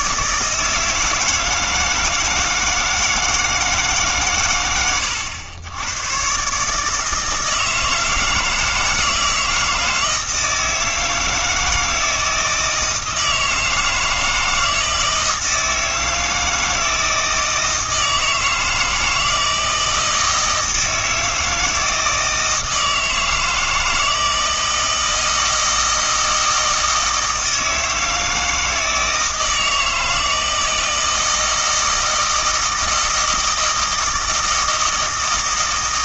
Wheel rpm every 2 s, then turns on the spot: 160, 160, 100, 140, 160, 160, 160, 160, 160, 160, 160, 160, 160, 160, 160, 160, 160, 160.
none